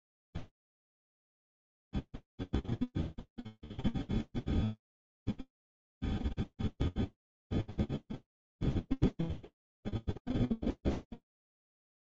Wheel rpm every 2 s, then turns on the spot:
0, 0, 0, 0, 0, 0.
none